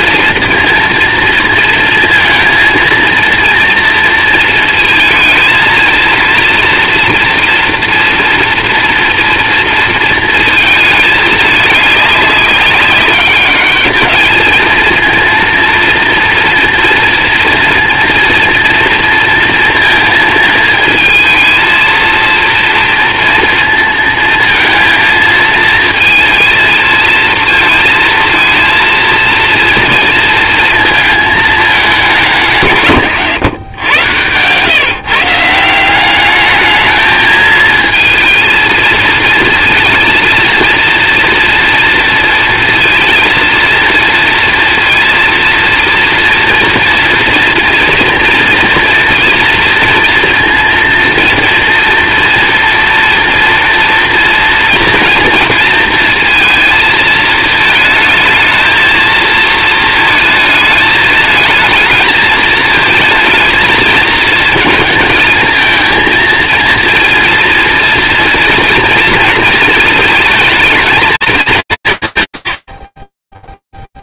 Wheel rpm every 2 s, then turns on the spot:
230, 230, 220, 230, 230, 220, 200, 230, 230, 230, 220, 230, 230, 230, 230, 220, 130, 150, 220, 230, 230, 230, 230, 230, 230, 230, 230, 230, 220, 220, 220, 220, 220, 230, 230, 220, 60.
32-34